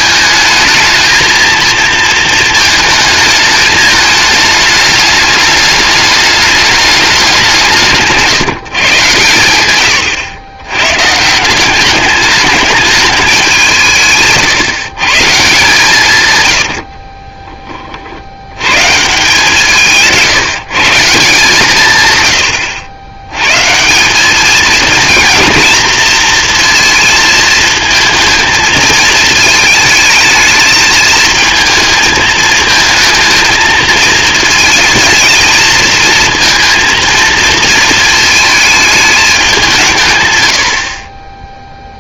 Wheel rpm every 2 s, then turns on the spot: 220, 220, 210, 210, 140, 100, 210, 140, 100, 130, 160, 80, 220, 230, 230, 220, 220, 220, 230, 220, 80.
16-18